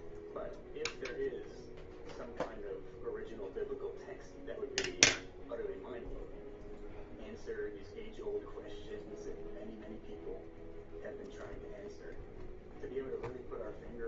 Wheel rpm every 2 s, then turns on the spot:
0, 0, 0, 0, 0, 0, 0.
none